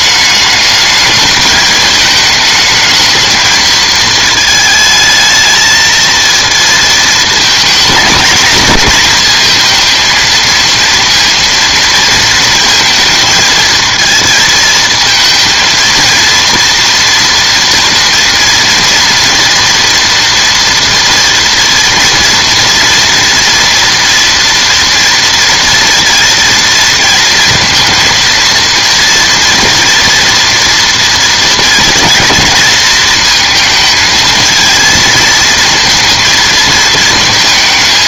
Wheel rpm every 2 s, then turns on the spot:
210, 220, 220, 230, 230, 230, 230, 220, 230, 230, 230, 230, 230, 230, 230, 230, 230, 230, 220.
none